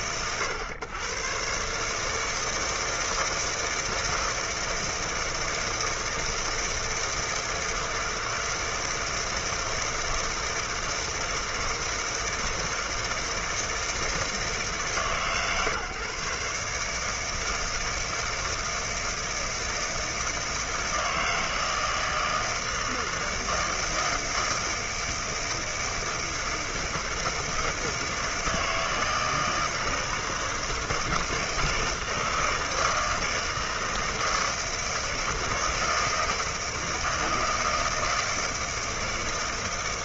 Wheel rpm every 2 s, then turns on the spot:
110, 160, 160, 160, 160, 160, 160, 160, 140, 160, 160, 160, 160, 160, 160, 160, 160, 160, 160, 160.
none